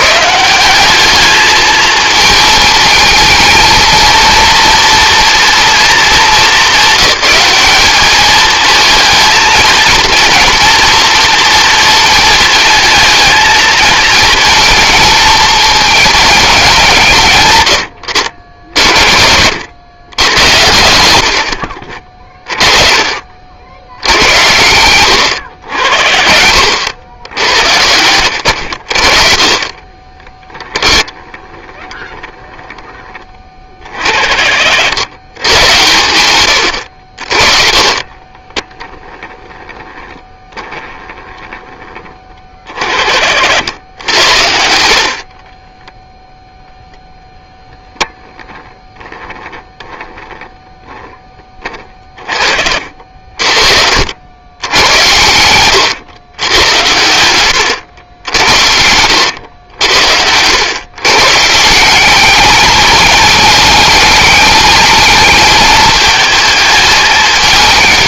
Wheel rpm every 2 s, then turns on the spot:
190, 220, 230, 210, 220, 230, 220, 220, 170, 60, 100, 30, 100, 80, 80, 10, 10, 80, 90, 10, 10, 40, 60, 0, 10, 10, 40, 100, 100, 90, 120, 210, 220, 220.
18-20 30-32